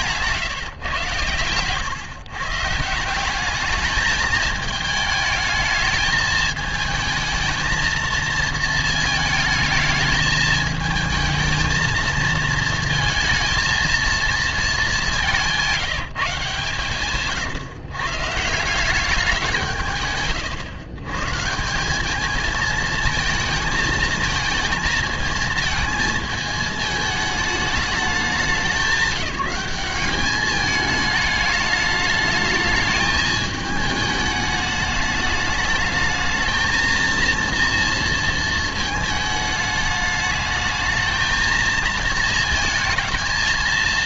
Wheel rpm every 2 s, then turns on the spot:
140, 140, 220, 220, 230, 220, 230, 220, 140, 160, 130, 220, 220, 220, 190, 210, 210, 210, 220, 220, 210, 230.
none